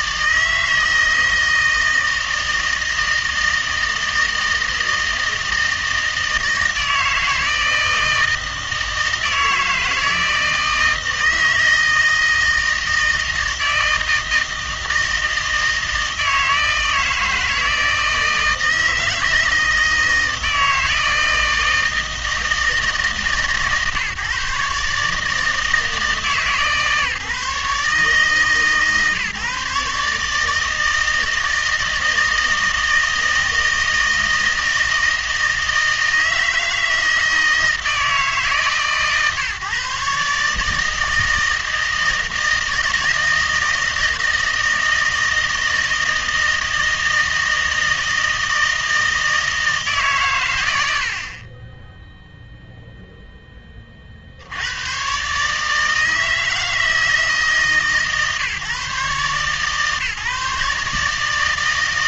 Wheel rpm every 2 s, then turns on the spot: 160, 160, 160, 160, 160, 160, 160, 160, 160, 160, 160, 160, 140, 150, 150, 160, 160, 160, 160, 150, 150, 160, 160, 160, 160, 100, 0, 90, 160, 150, 150.
none